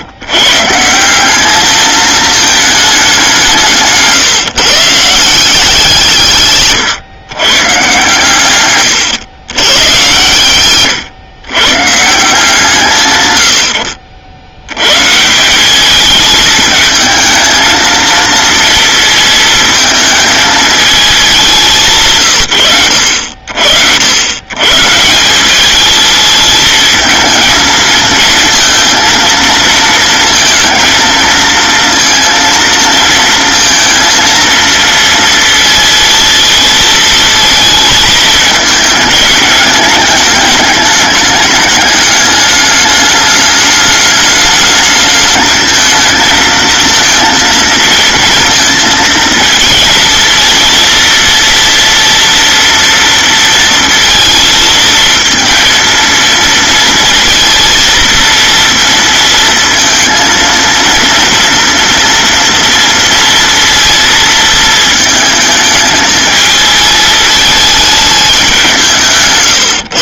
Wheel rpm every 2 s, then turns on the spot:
160, 210, 150, 130, 110, 120, 140, 120, 220, 230, 220, 100, 150, 220, 230, 220, 230, 230, 220, 210, 210, 210, 210, 230, 230, 230, 230, 220, 230, 230, 230, 230, 220, 220, 180.
none